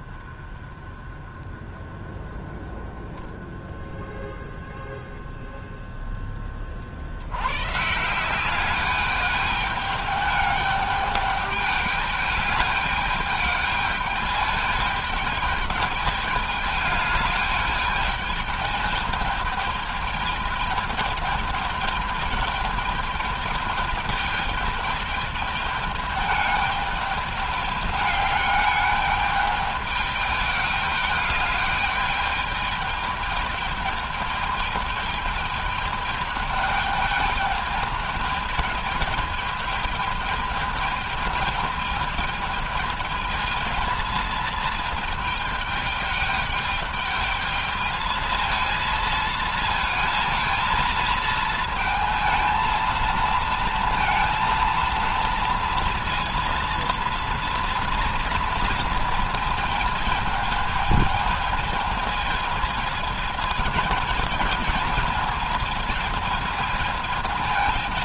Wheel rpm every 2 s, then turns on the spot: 20, 20, 0, 20, 190, 210, 210, 210, 210, 210, 210, 210, 210, 210, 210, 210, 210, 210, 210, 210, 210, 210, 220, 210, 220, 230, 230, 230, 230, 230, 220, 220, 220, 220.
none